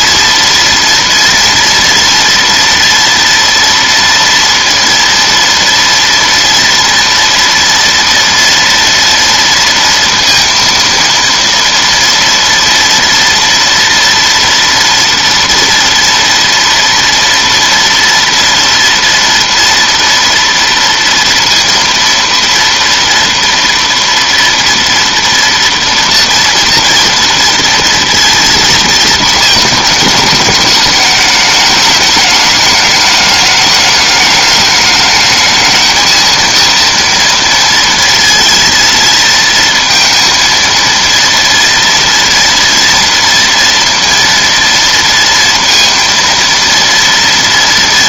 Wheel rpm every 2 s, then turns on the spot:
230, 230, 230, 240, 230, 230, 230, 230, 230, 230, 230, 230, 230, 230, 230, 210, 210, 210, 230, 230, 230, 230, 230, 230.
none